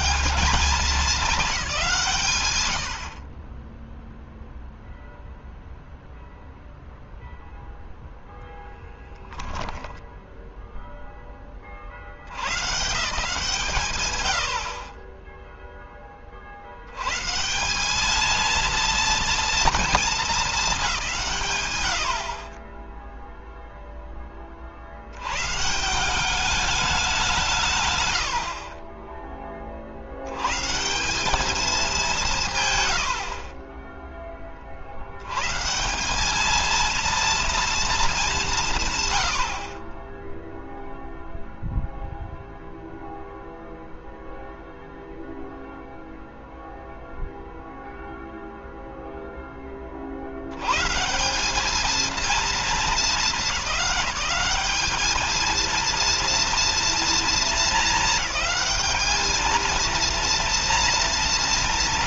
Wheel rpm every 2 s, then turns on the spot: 210, 40, 0, 0, 0, 0, 150, 40, 120, 230, 180, 10, 60, 200, 30, 180, 130, 70, 230, 140, 0, 0, 0, 0, 0, 140, 220, 210, 230, 220, 190.
none